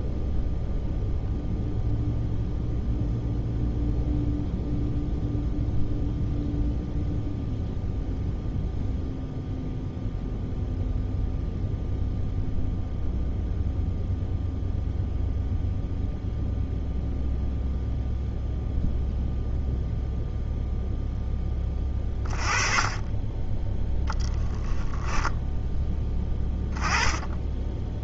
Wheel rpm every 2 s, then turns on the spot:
0, 0, 0, 0, 0, 0, 0, 0, 0, 0, 0, 20, 10, 10.
none